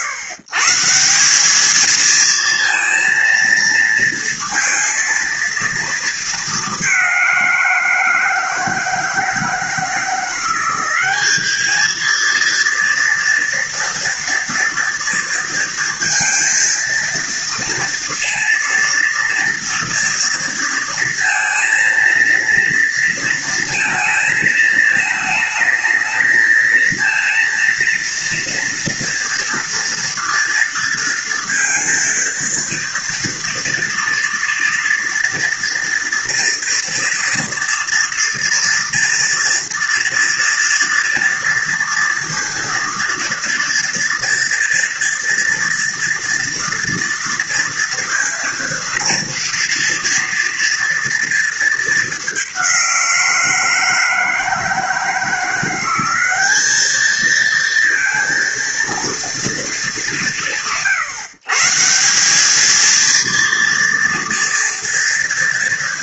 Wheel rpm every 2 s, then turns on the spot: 160, 230, 230, 210, 160, 180, 230, 240, 230, 230, 230, 230, 220, 220, 230, 230, 230, 230, 230, 240, 230, 230, 230, 230, 230, 230, 200, 160, 200, 230, 140, 210, 230.
none